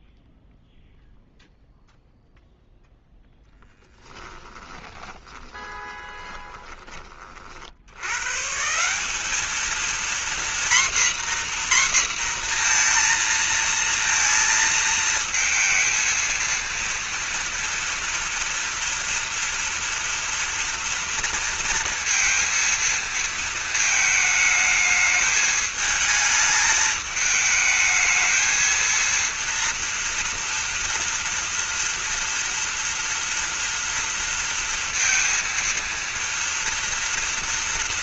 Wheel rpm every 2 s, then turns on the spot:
0, 0, 10, 20, 180, 250, 230, 220, 230, 230, 230, 230, 210, 220, 230, 230, 230, 230, 230.
4-6